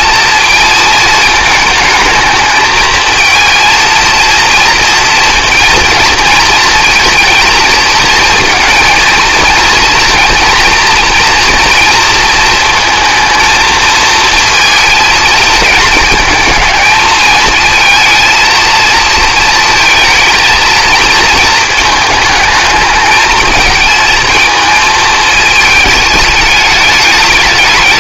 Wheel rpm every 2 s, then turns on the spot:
230, 220, 230, 230, 230, 230, 230, 230, 220, 230, 230, 220, 220, 210.
none